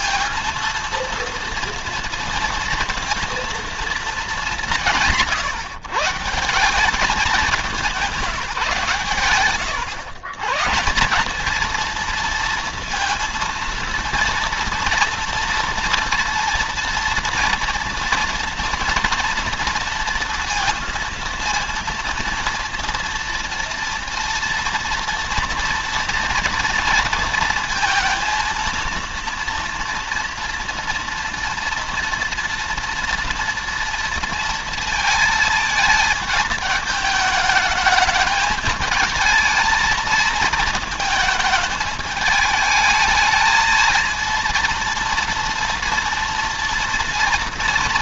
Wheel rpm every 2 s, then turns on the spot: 230, 230, 180, 190, 150, 150, 230, 240, 230, 240, 230, 230, 230, 230, 230, 230, 230, 230, 220, 220, 220, 220, 230, 240.
none